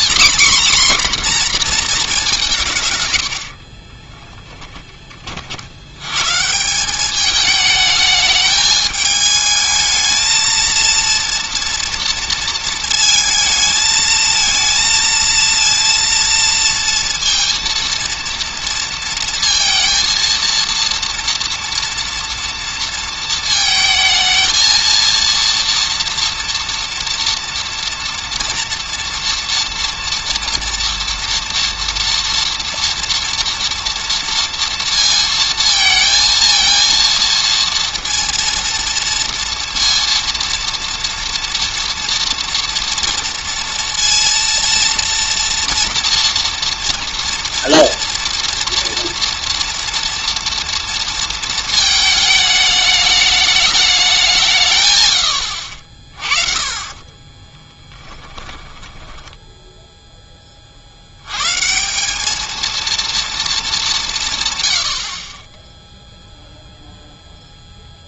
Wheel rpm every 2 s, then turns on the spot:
260, 150, 10, 170, 210, 230, 230, 230, 230, 230, 230, 230, 230, 230, 230, 230, 230, 230, 230, 230, 230, 230, 230, 230, 230, 230, 210, 150, 40, 20, 40, 220, 120, 0.
2-4 56-60